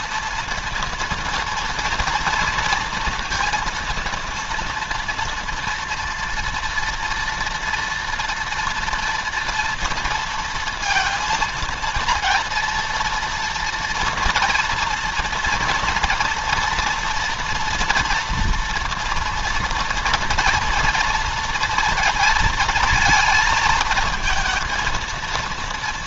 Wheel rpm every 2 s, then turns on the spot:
230, 230, 230, 230, 240, 230, 230, 230, 230, 230, 230, 230, 230.
none